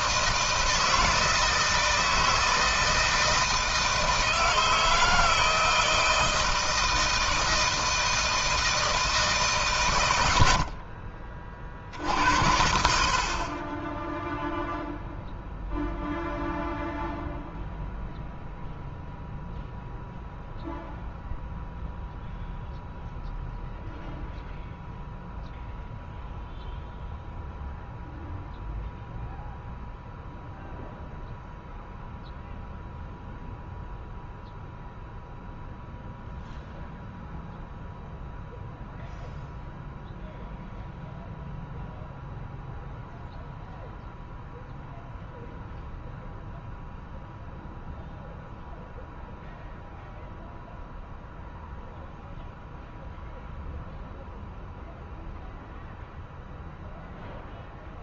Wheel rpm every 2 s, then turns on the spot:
160, 160, 160, 160, 160, 90, 80, 0, 0, 0, 0, 0, 0, 0, 0, 0, 0, 0, 0, 0, 0, 0, 0, 0, 0, 0, 0, 0, 0.
10-12